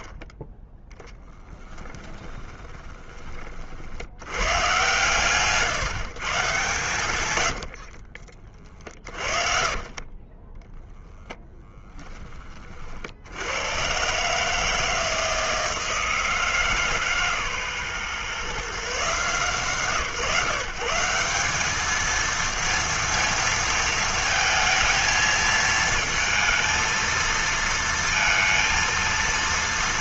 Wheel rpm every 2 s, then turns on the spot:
10, 20, 130, 120, 30, 30, 50, 160, 160, 150, 160, 230, 230, 230, 230.
2-4 8-12